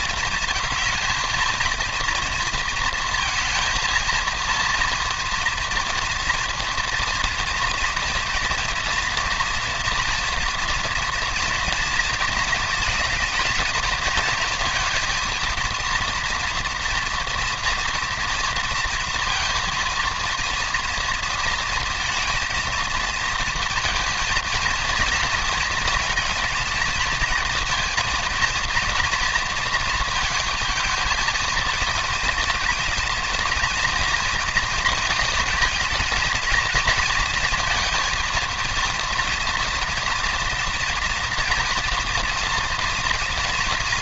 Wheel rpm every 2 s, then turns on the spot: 230, 230, 230, 230, 230, 230, 220, 230, 230, 230, 230, 220, 230, 230, 230, 220, 220, 230, 230, 230, 240, 230.
none